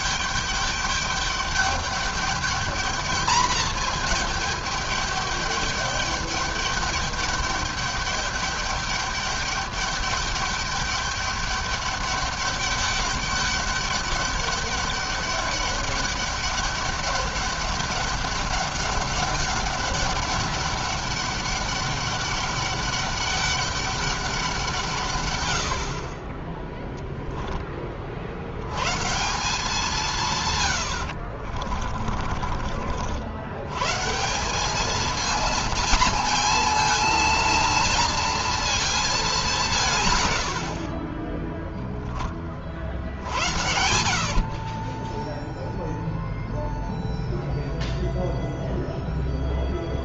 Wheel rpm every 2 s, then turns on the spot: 210, 220, 210, 210, 200, 200, 200, 200, 200, 200, 200, 200, 160, 10, 110, 100, 60, 210, 230, 230, 60, 40, 30, 0, 0.
30-32